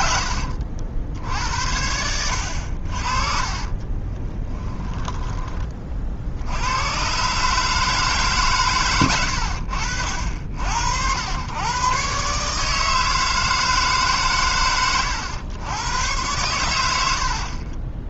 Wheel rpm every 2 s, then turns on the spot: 80, 50, 10, 100, 120, 70, 150, 100, 80.
4-6